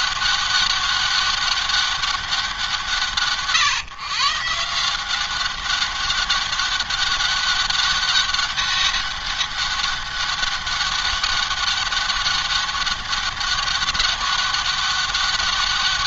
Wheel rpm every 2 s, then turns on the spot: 200, 170, 160, 200, 200, 200, 200, 200.
none